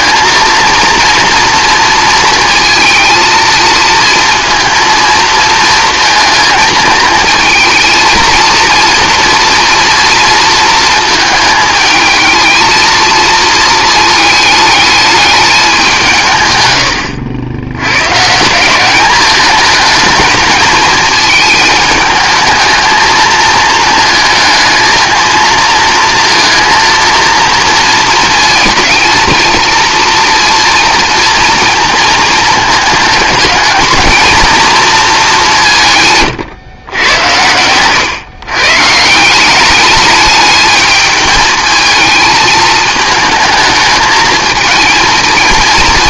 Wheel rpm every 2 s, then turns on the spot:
230, 230, 230, 220, 230, 230, 230, 220, 110, 180, 220, 220, 220, 230, 220, 230, 220, 230, 120, 140, 210, 220, 230.
none